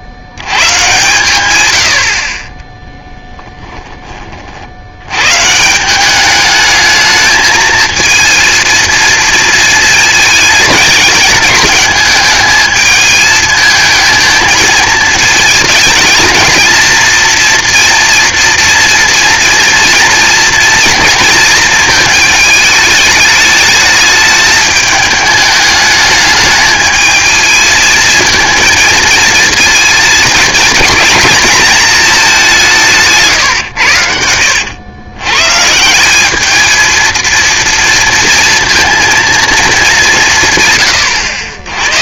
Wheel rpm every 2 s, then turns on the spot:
120, 20, 90, 210, 230, 210, 210, 220, 230, 240, 230, 210, 210, 220, 220, 220, 170, 110, 220, 230, 130.
2-4